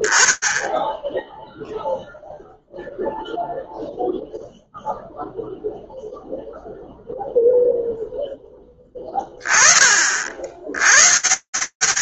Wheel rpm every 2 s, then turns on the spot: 0, 0, 0, 0, 20, 110.
none